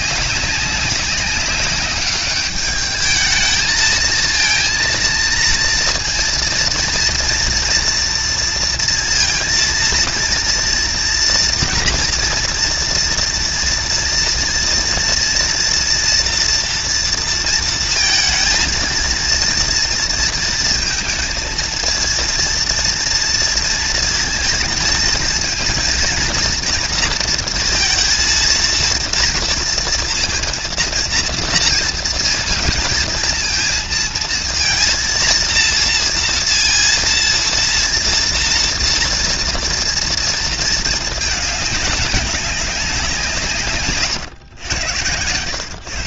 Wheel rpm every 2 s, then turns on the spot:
200, 200, 220, 230, 230, 230, 230, 240, 230, 230, 230, 230, 230, 230, 230, 230, 220, 230, 230, 230, 230, 200, 90.
none